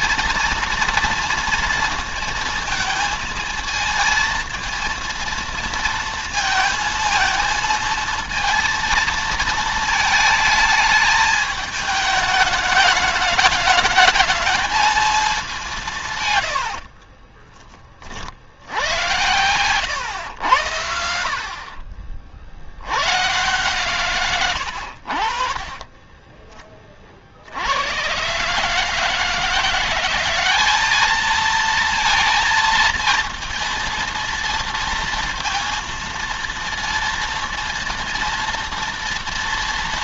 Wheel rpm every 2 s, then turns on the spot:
240, 230, 230, 230, 230, 210, 210, 220, 70, 70, 80, 90, 80, 20, 140, 200, 230, 230, 230, 230.
16-18